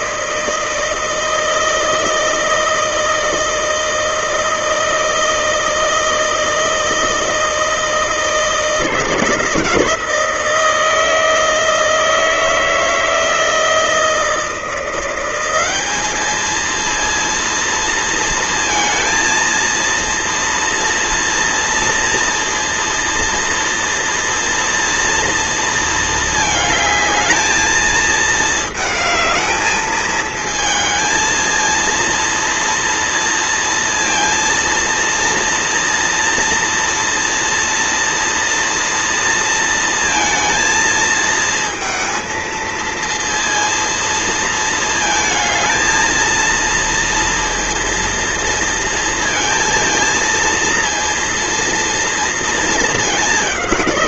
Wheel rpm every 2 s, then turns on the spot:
160, 160, 160, 160, 170, 160, 160, 170, 230, 230, 230, 230, 230, 220, 220, 230, 230, 230, 230, 230, 220, 220, 230, 230, 230, 230, 220.
none